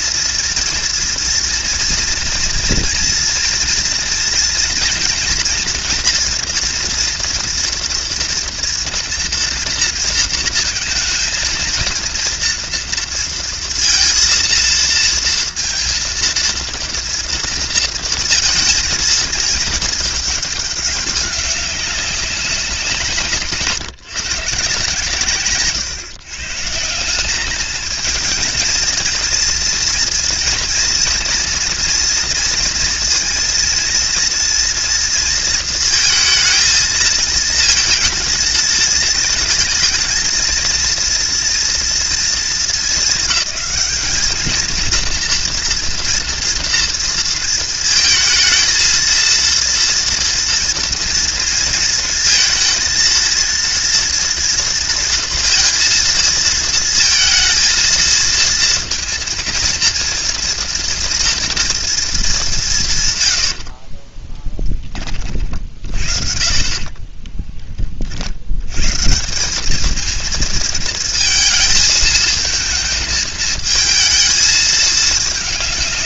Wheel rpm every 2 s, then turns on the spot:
230, 240, 230, 230, 230, 230, 230, 230, 230, 230, 200, 180, 150, 150, 230, 230, 230, 230, 220, 220, 230, 220, 220, 230, 220, 230, 220, 230, 230, 230, 230, 180, 20, 40, 100, 230, 220, 220.
66-68